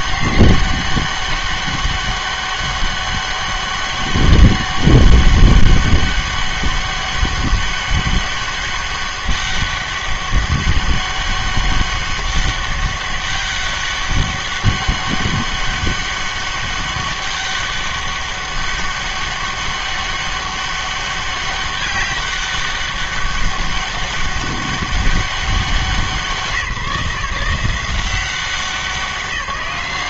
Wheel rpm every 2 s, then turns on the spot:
200, 200, 200, 200, 200, 200, 200, 200, 200, 200, 200, 200, 200, 170, 190.
none